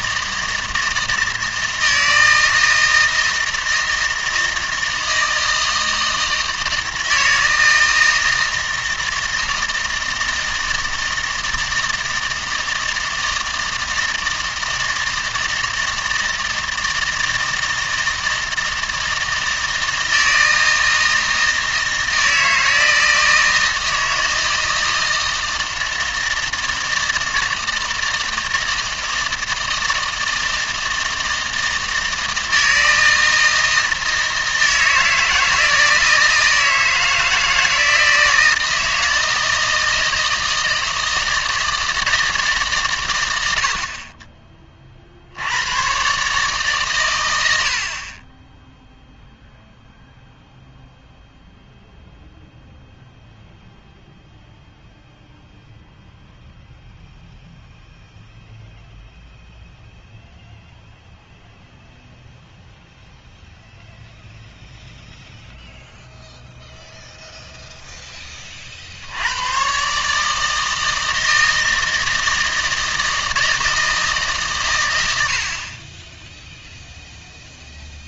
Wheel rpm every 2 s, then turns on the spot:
160, 160, 160, 160, 160, 160, 160, 160, 160, 160, 160, 160, 160, 160, 160, 160, 160, 160, 160, 160, 160, 130, 30, 140, 10, 0, 0, 0, 0, 0, 0, 0, 0, 0, 40, 160, 160, 110, 0.
none